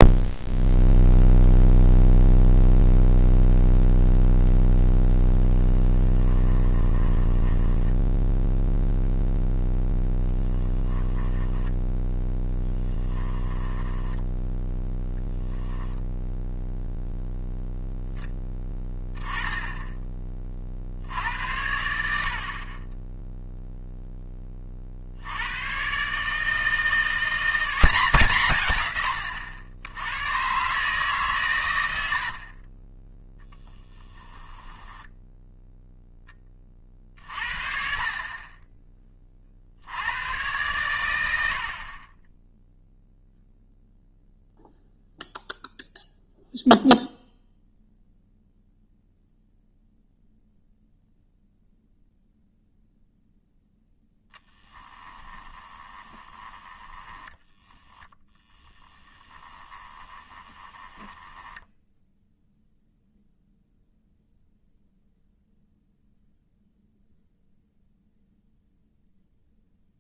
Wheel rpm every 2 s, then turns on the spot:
0, 0, 0, 20, 0, 20, 10, 10, 0, 10, 60, 20, 40, 170, 130, 150, 20, 10, 40, 20, 120, 0, 0, 0, 0, 0, 0, 10, 10, 10, 20, 0, 0, 0, 0.
6-8 10-14 32-36 54-62